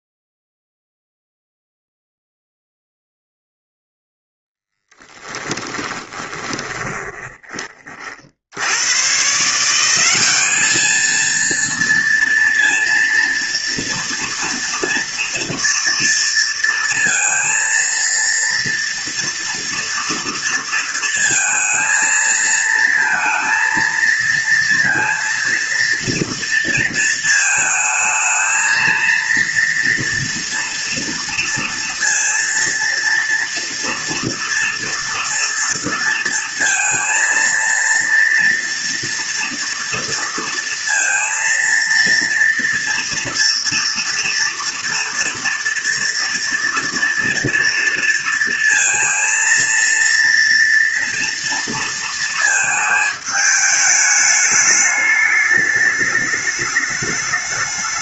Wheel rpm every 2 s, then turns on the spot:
0, 0, 10, 20, 120, 220, 230, 230, 230, 230, 230, 230, 230, 230, 230, 230, 230, 230, 230, 230, 230, 240, 240, 240, 230, 230, 220, 210, 210.
4-8